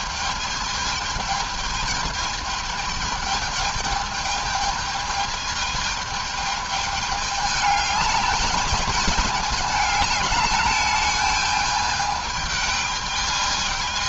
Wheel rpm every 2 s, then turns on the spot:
220, 220, 220, 210, 210, 210, 210.
none